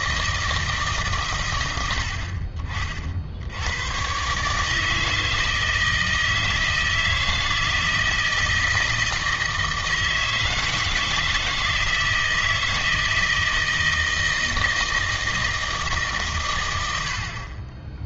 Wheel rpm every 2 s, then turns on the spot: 150, 40, 160, 160, 160, 160, 160, 160, 90.
none